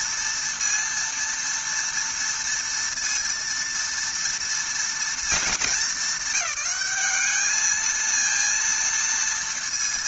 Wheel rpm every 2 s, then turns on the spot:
230, 230, 240, 210, 230.
none